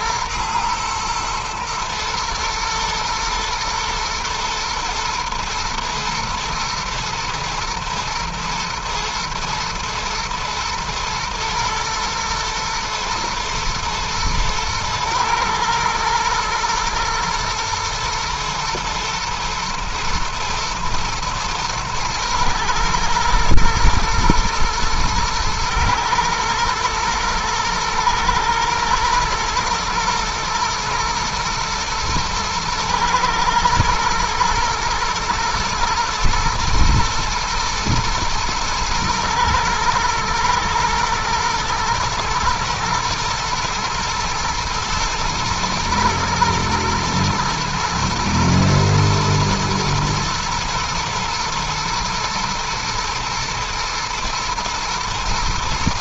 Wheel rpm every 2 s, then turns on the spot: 120, 110, 110, 110, 110, 120, 120, 110, 110, 110, 120, 110, 120, 120, 110, 120, 110, 110, 120, 120, 110, 110, 110, 120, 120, 120, 120, 120.
none